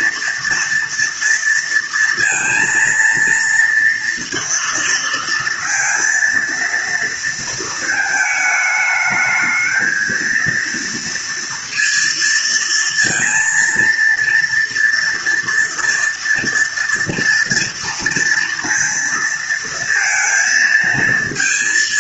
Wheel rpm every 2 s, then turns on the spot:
230, 230, 230, 230, 220, 230, 230, 230, 230, 230, 230.
none